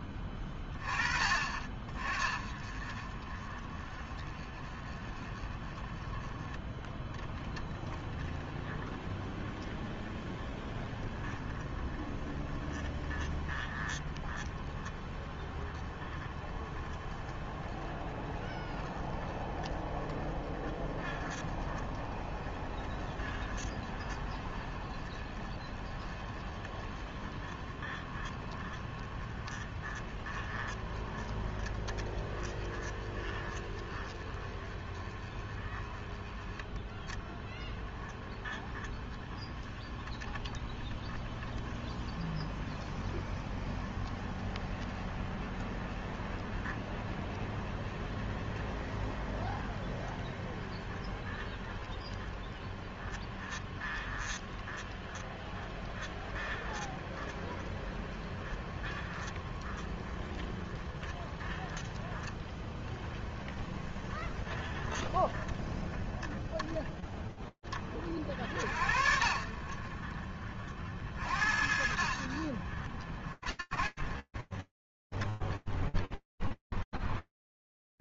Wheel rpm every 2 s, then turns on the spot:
40, 20, 10, 20, 20, 20, 20, 20, 20, 20, 20, 20, 20, 20, 20, 20, 20, 20, 20, 20, 20, 20, 20, 20, 20, 20, 20, 20, 20, 20, 20, 20, 10, 30, 40, 60, 60, 10, 20.
none